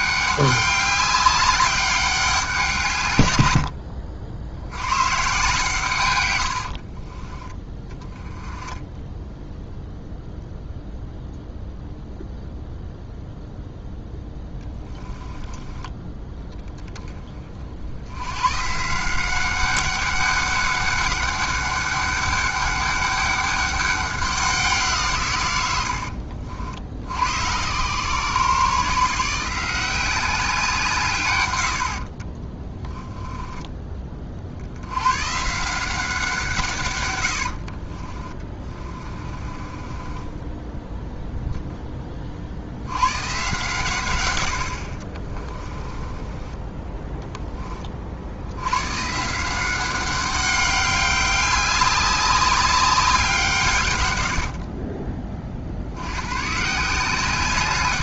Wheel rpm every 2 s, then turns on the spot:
200, 160, 100, 60, 10, 0, 0, 10, 10, 140, 200, 200, 170, 70, 150, 170, 10, 70, 140, 30, 10, 80, 60, 10, 110, 200, 190, 40, 160.
6-8 38-42 44-46